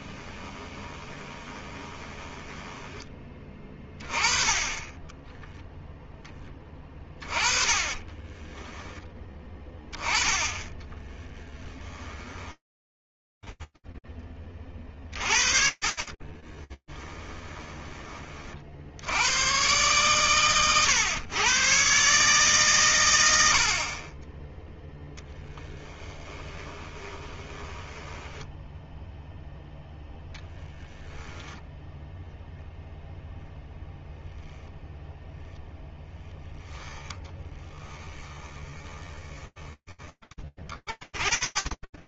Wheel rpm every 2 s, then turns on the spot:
20, 10, 20, 20, 10, 20, 20, 40, 20, 110, 110, 80, 20, 10, 10, 10, 0, 10, 10, 20, 30.
0-4 10-18 24-28 36-38 40-42